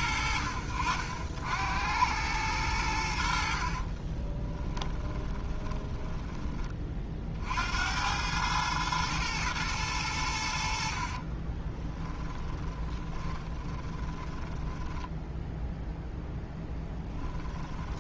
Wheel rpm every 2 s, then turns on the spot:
60, 90, 10, 30, 110, 60, 10, 10, 10.
4-6 10-18